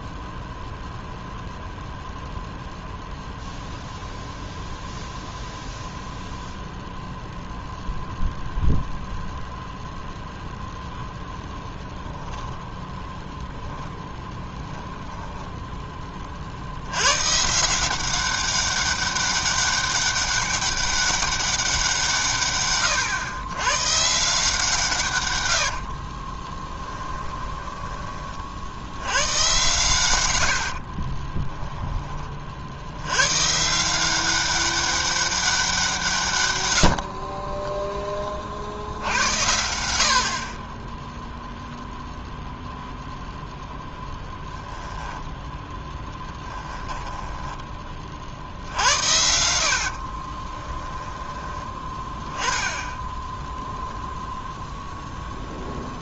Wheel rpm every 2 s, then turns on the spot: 0, 0, 0, 0, 0, 0, 10, 20, 70, 190, 200, 130, 160, 10, 30, 90, 60, 190, 90, 60, 40, 0, 10, 10, 70, 20, 10, 0.
12-16 26-28 44-48 50-52